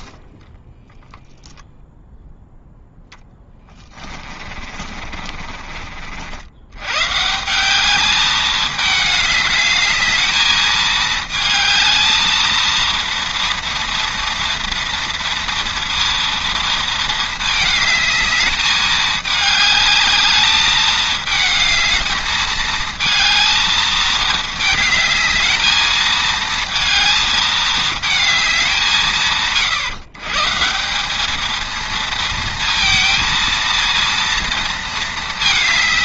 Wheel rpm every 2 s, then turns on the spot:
10, 0, 40, 110, 210, 220, 230, 230, 230, 210, 210, 220, 220, 220, 170, 190, 230, 230.
0-2 4-6